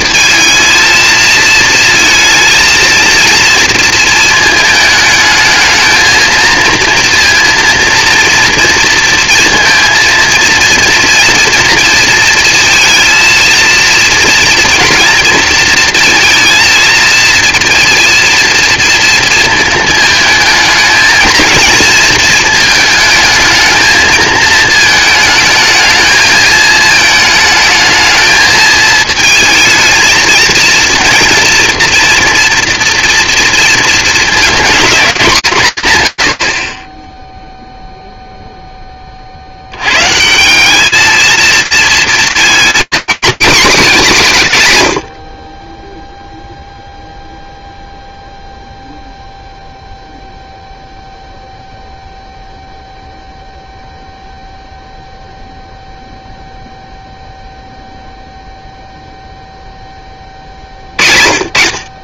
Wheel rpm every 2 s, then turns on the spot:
230, 230, 220, 230, 230, 230, 220, 230, 220, 230, 220, 220, 220, 220, 220, 230, 240, 230, 60, 10, 200, 230, 150, 0, 0, 0, 0, 0, 0, 0, 60.
none